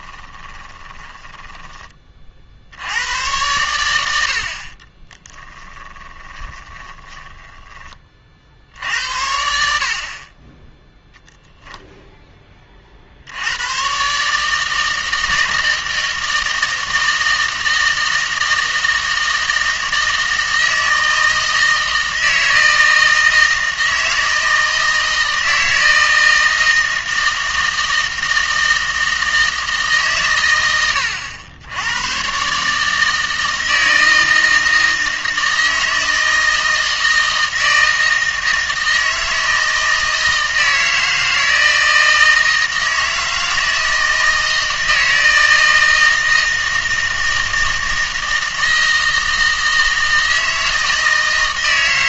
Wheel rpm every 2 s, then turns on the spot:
20, 80, 40, 10, 70, 10, 30, 160, 160, 160, 160, 160, 160, 160, 160, 90, 150, 160, 160, 160, 160, 160, 160, 160, 160, 160.
0-2 4-8